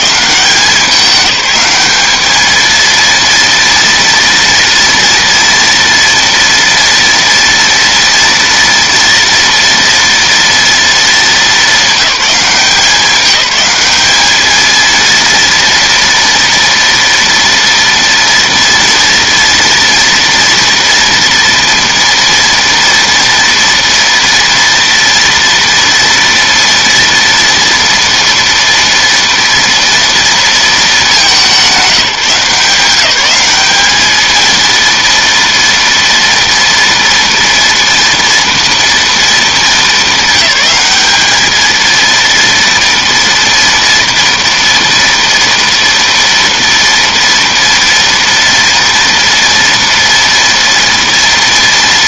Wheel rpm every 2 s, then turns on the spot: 200, 230, 230, 230, 230, 220, 190, 230, 230, 230, 240, 230, 230, 230, 230, 210, 190, 230, 230, 230, 210, 230, 230, 230, 230, 230.
none